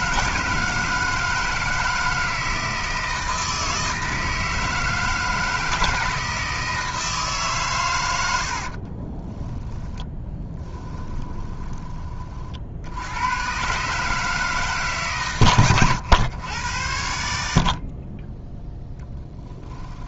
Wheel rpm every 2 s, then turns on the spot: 160, 160, 160, 160, 40, 10, 80, 150, 90, 0.
8-12